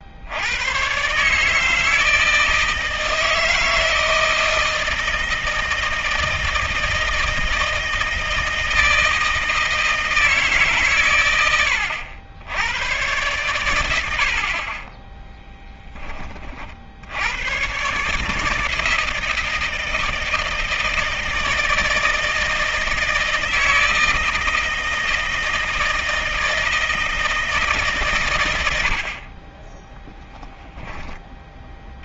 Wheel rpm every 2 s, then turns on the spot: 80, 160, 160, 160, 160, 150, 90, 50, 30, 150, 160, 160, 160, 160, 110, 10.
none